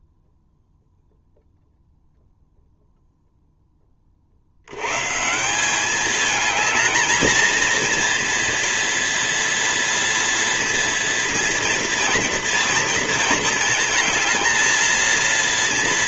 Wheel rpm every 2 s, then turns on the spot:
0, 0, 80, 220, 230, 230, 230, 220.
none